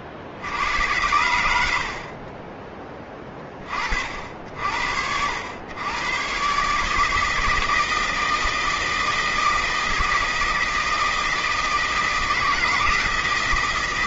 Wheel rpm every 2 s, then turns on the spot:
80, 20, 70, 140, 160, 160, 160.
none